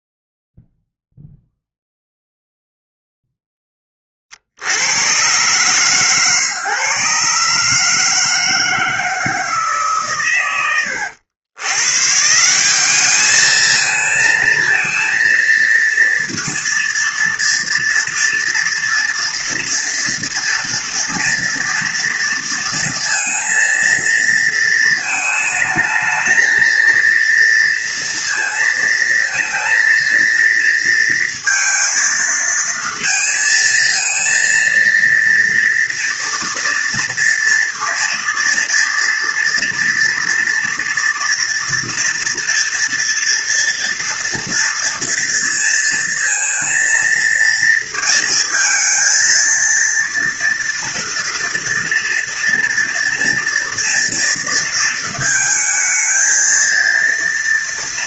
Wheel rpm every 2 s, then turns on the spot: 0, 0, 60, 130, 160, 110, 180, 220, 230, 240, 230, 230, 220, 230, 230, 230, 230, 230, 230, 230, 230, 230, 230, 230, 230, 230, 230, 230, 230.
none